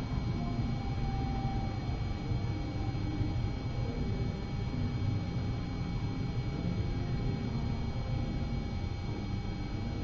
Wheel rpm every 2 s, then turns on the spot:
0, 0, 0, 0, 0.
none